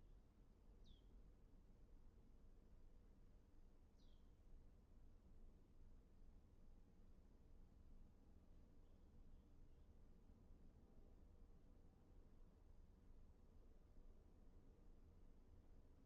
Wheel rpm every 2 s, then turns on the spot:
0, 0, 0, 0, 0, 0, 0, 0.
none